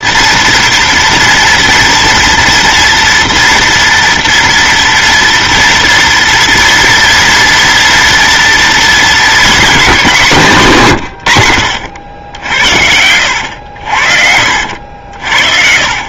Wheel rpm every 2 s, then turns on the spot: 230, 240, 230, 230, 230, 160, 70, 70.
14-16